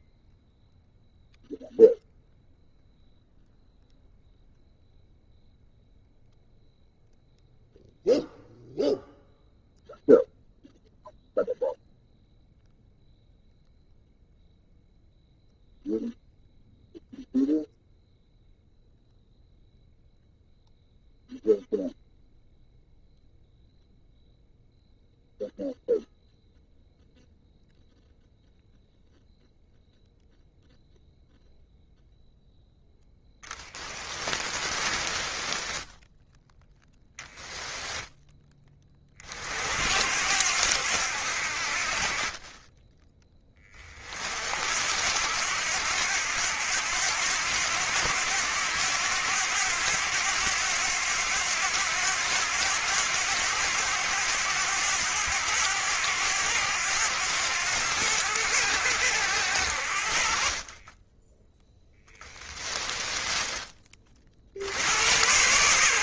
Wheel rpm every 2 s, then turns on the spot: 0, 0, 0, 0, 0, 0, 0, 0, 0, 0, 0, 0, 0, 0, 0, 0, 0, 20, 0, 30, 70, 10, 70, 90, 90, 90, 90, 90, 90, 80, 20, 20, 80.
34-36 60-64